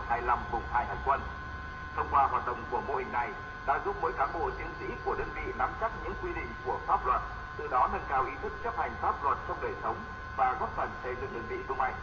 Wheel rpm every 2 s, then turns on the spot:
0, 0, 0, 0, 0, 0.
none